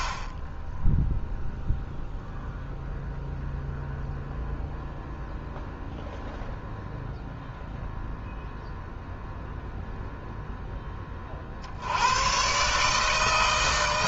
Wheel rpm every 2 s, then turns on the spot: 0, 0, 0, 0, 0, 20, 150.
none